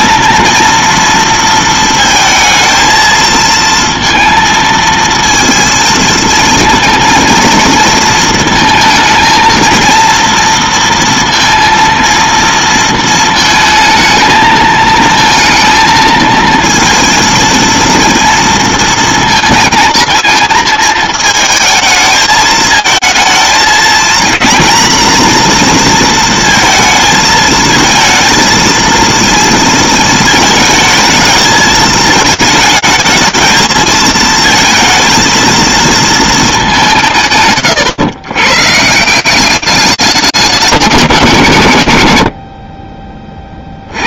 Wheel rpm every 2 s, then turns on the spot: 220, 230, 220, 230, 230, 230, 230, 230, 230, 230, 220, 220, 230, 230, 220, 230, 220, 220, 220, 130, 160, 30.
none